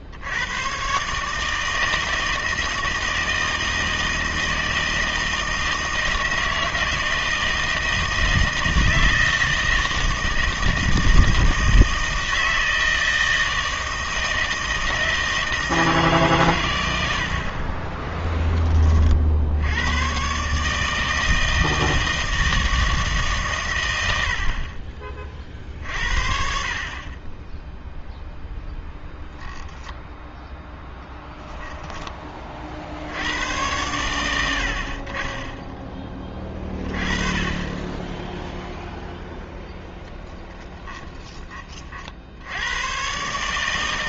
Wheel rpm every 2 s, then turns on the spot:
70, 160, 160, 160, 160, 160, 160, 160, 130, 20, 140, 160, 60, 50, 0, 10, 30, 80, 30, 0, 10, 80.
none